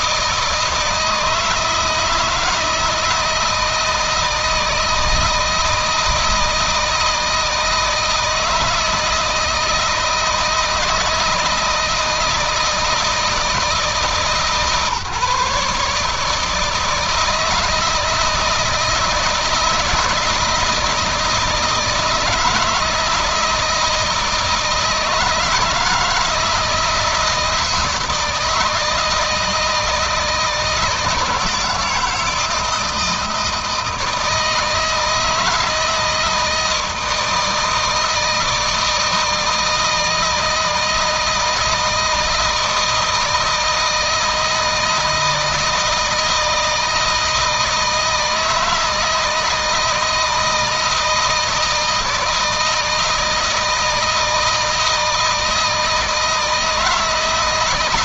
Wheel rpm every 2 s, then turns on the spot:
160, 160, 160, 160, 160, 160, 170, 150, 160, 160, 160, 160, 160, 160, 160, 160, 160, 160, 160, 160, 160, 160, 160, 160, 160, 160, 160, 160, 160.
none